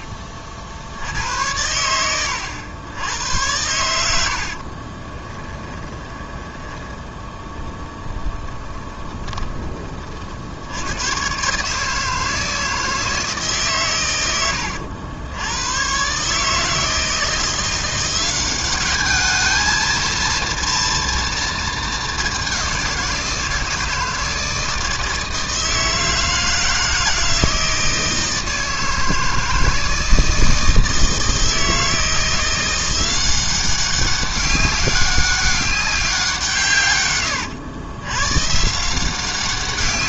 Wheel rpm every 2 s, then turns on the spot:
60, 100, 30, 20, 20, 110, 160, 80, 160, 210, 230, 180, 160, 160, 160, 160, 180, 200, 130, 160.
4-6 8-10